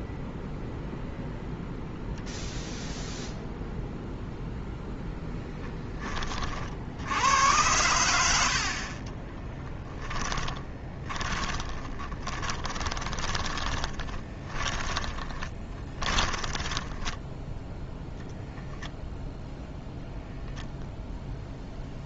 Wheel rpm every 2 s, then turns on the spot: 0, 0, 0, 60, 50, 20, 30, 10, 10, 0, 0.
10-18